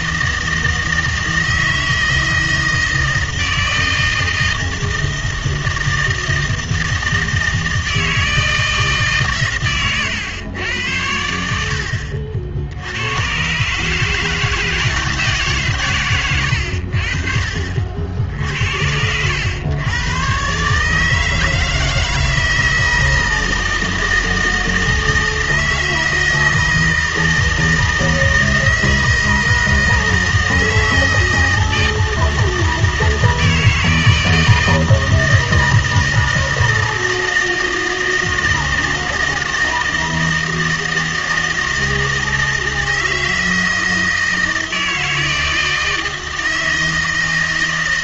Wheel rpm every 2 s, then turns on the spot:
160, 160, 160, 160, 160, 100, 80, 170, 90, 70, 140, 160, 160, 160, 160, 160, 160, 160, 160, 160, 160, 160, 160, 160.
none